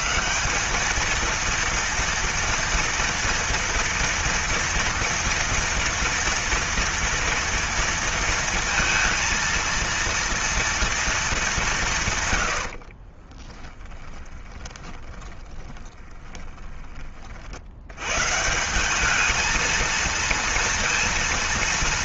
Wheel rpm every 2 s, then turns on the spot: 210, 230, 230, 230, 230, 230, 60, 20, 20, 190, 230.
12-16